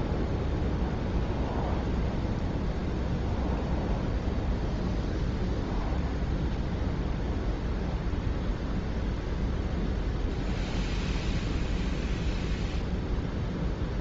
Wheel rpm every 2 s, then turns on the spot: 0, 0, 0, 0, 0, 0, 0.
none